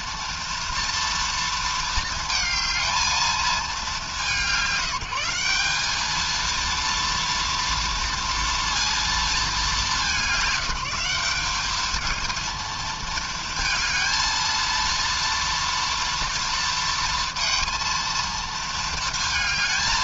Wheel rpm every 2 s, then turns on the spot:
230, 230, 180, 230, 230, 180, 220, 230, 230, 230.
none